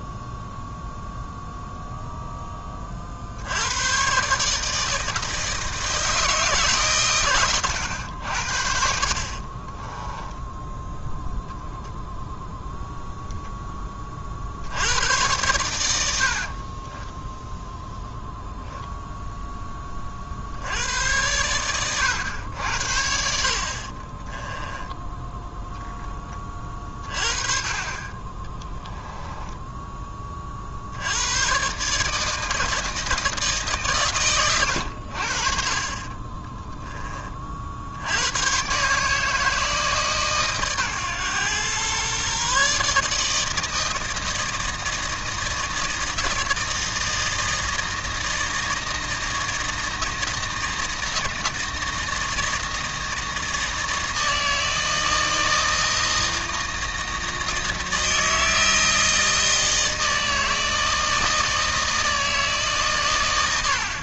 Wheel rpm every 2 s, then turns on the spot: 0, 20, 150, 140, 70, 0, 0, 70, 30, 0, 90, 80, 10, 30, 10, 60, 160, 90, 10, 130, 130, 140, 160, 160, 160, 160, 160, 160, 160, 160, 160, 140.
16-18 24-26 28-30